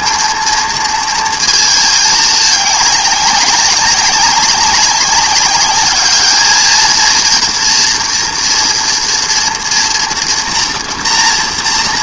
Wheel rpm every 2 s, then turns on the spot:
230, 220, 200, 210, 230, 230.
none